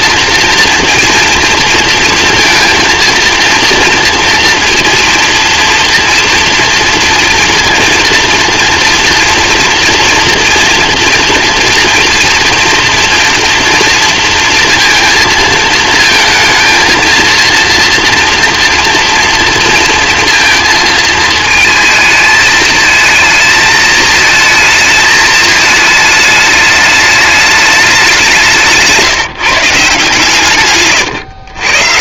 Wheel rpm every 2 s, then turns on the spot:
230, 230, 240, 230, 240, 230, 230, 230, 230, 230, 230, 220, 220, 210, 160, 120.
30-32